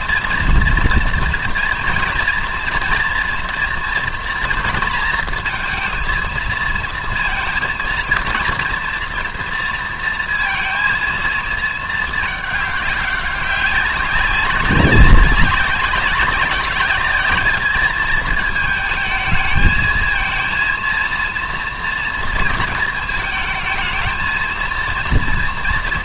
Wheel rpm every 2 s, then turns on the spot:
230, 240, 230, 230, 240, 230, 200, 200, 210, 220, 230, 220, 230.
none